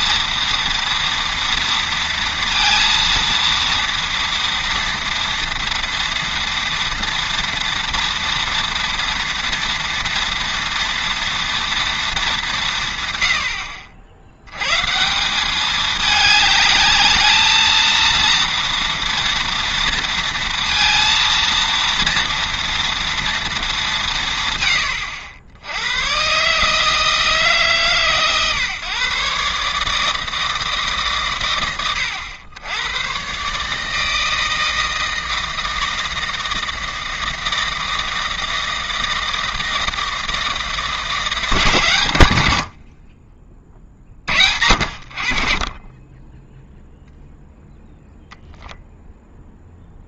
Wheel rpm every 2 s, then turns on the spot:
230, 230, 230, 230, 230, 230, 180, 120, 210, 230, 230, 230, 120, 140, 130, 160, 90, 160, 160, 160, 160, 80, 70, 0, 0.
none